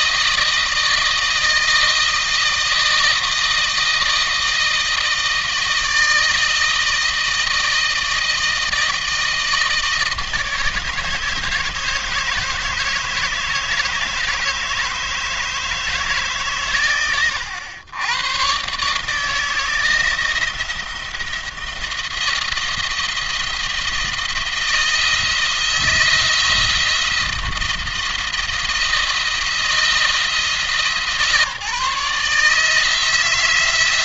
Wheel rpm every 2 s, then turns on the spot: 160, 160, 160, 160, 160, 160, 150, 160, 120, 140, 170, 170, 160, 170, 170, 160, 160.
none